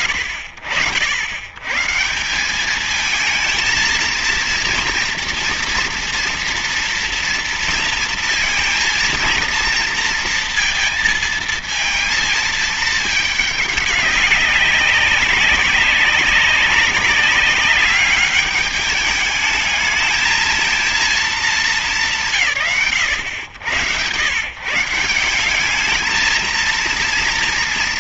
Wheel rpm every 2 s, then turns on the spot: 80, 200, 230, 230, 230, 230, 220, 200, 200, 210, 220, 80, 140, 230.
none